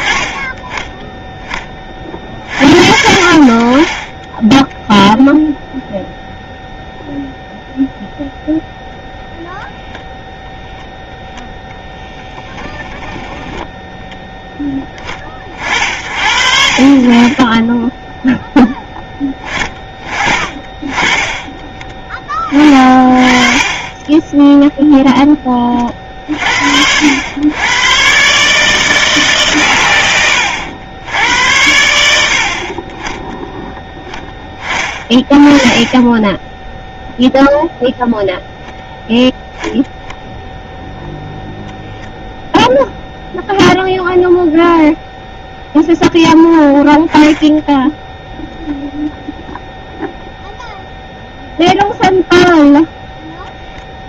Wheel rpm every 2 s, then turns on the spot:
10, 60, 10, 0, 0, 0, 10, 10, 50, 0, 30, 40, 0, 70, 160, 100, 40, 30, 10, 0, 0, 0, 0, 10, 0, 0, 0.
12-14